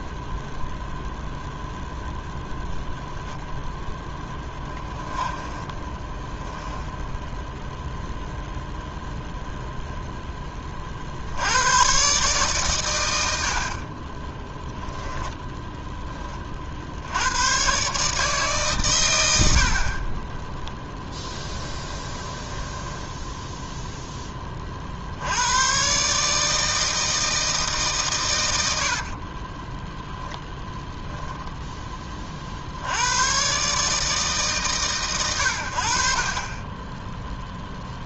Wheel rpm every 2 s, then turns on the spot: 0, 0, 10, 10, 0, 20, 130, 10, 40, 140, 10, 10, 30, 160, 100, 10, 60, 140, 30.
4-8 14-16 22-24